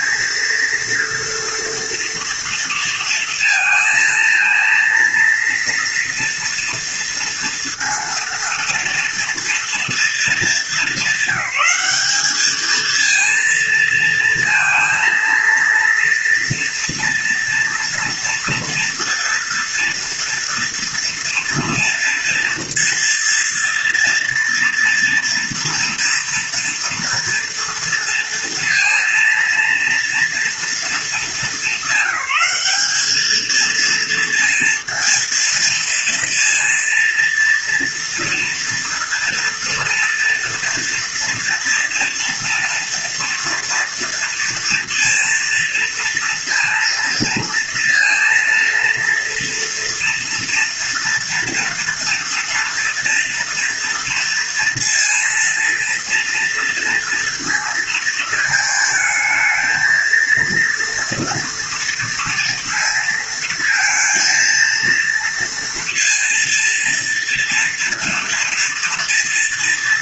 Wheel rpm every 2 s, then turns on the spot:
230, 230, 230, 230, 230, 200, 220, 230, 230, 230, 230, 230, 230, 230, 230, 220, 200, 230, 230, 230, 230, 230, 230, 230, 230, 230, 230, 230, 230, 220, 230, 230, 230, 230, 230.
none